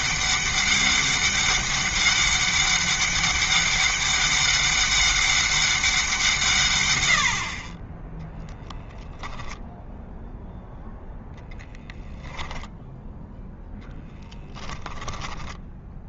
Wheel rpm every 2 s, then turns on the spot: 200, 200, 200, 120, 0, 0, 0, 0.
none